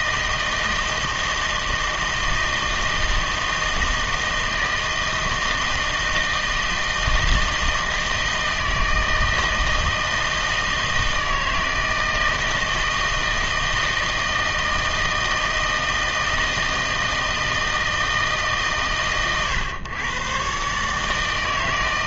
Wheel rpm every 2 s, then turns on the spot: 160, 160, 160, 160, 160, 160, 160, 160, 160, 150, 140.
none